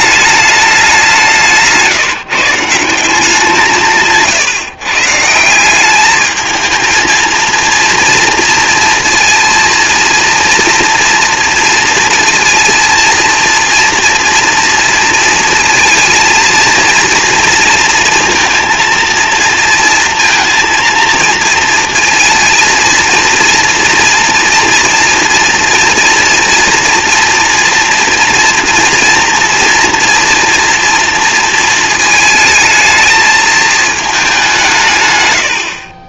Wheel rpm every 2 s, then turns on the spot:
190, 170, 140, 220, 230, 230, 230, 230, 230, 230, 230, 230, 230, 240, 240, 230, 220, 140.
none